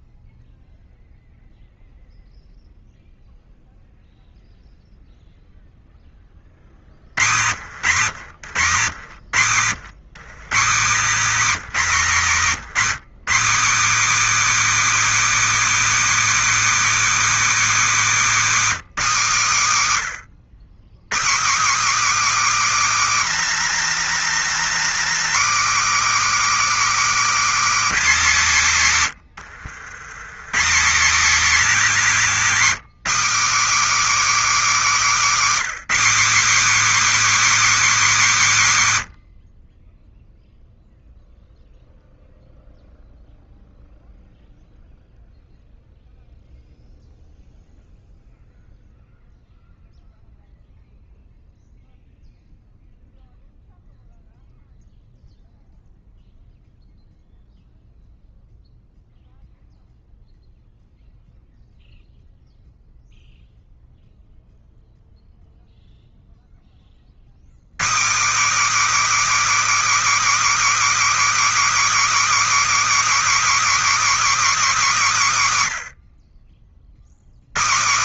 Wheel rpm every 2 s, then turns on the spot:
0, 0, 0, 60, 140, 210, 210, 320, 320, 260, 160, 320, 290, 290, 170, 180, 260, 300, 290, 200, 0, 0, 0, 0, 0, 0, 0, 0, 0, 0, 0, 0, 0, 20, 290, 330, 330, 280, 70.
none